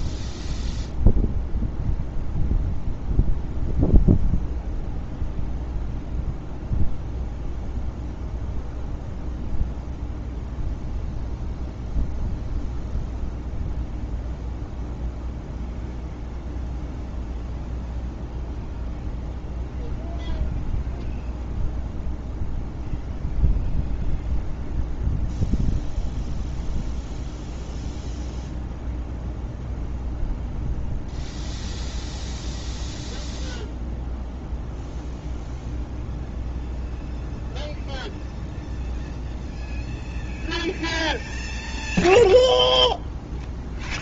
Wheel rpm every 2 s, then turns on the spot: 0, 0, 0, 0, 0, 0, 0, 0, 0, 0, 0, 0, 0, 0, 0, 0, 0, 0, 0, 0, 0, 0.
none